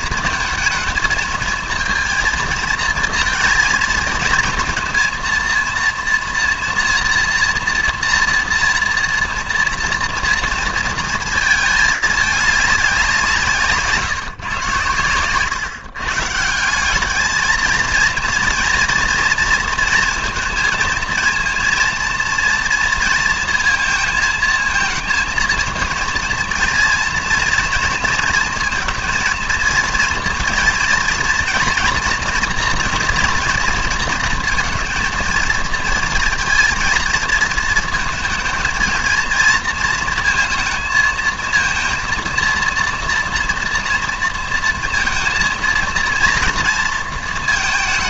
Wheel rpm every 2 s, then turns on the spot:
230, 230, 230, 230, 240, 230, 210, 120, 160, 230, 230, 230, 220, 230, 230, 230, 230, 230, 230, 230, 230, 230, 230, 230.
none